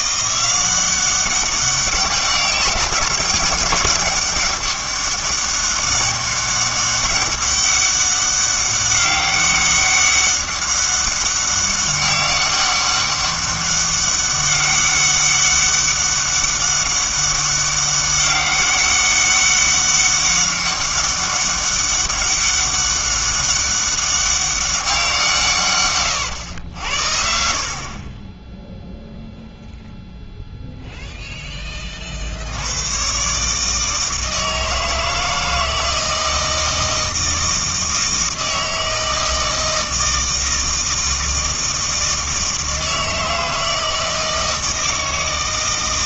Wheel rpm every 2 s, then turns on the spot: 190, 200, 200, 190, 200, 200, 200, 200, 200, 200, 200, 200, 190, 80, 0, 0, 90, 160, 160, 160, 160, 160, 160.
none